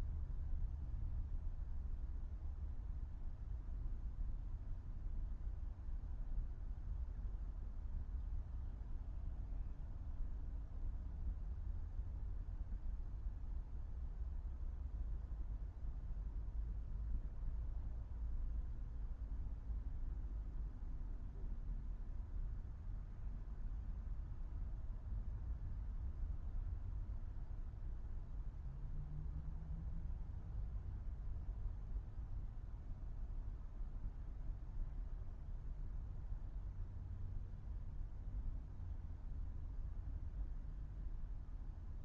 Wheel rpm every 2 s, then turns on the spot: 0, 0, 0, 0, 0, 0, 0, 0, 0, 0, 0, 0, 0, 0, 0, 0, 0, 0, 0, 0, 0.
none